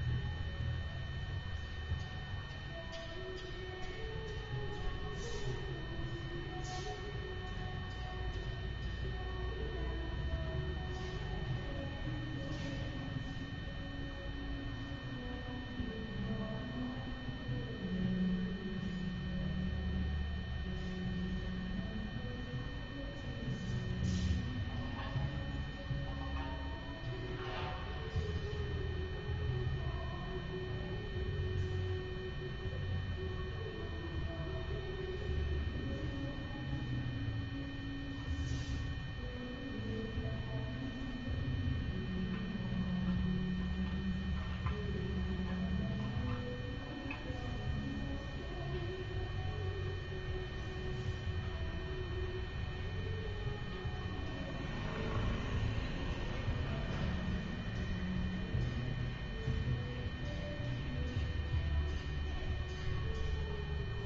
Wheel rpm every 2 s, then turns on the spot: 0, 0, 0, 0, 0, 0, 0, 0, 0, 0, 0, 0, 0, 0, 0, 0, 0, 0, 0, 0, 0, 0, 0, 0, 0, 0, 0, 0, 0, 0, 0, 0.
none